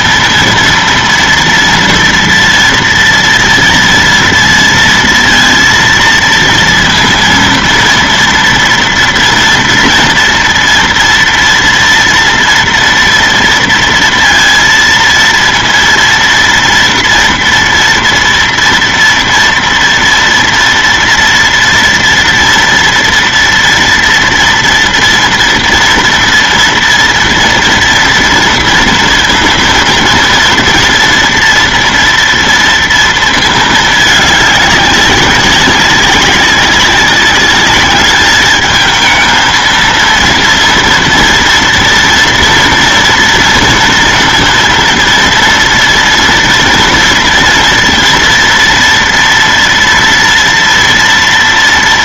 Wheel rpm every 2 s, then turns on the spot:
230, 230, 230, 230, 230, 230, 230, 230, 230, 230, 230, 230, 230, 240, 230, 230, 230, 200, 190, 210, 230, 230, 230, 230, 230, 230.
none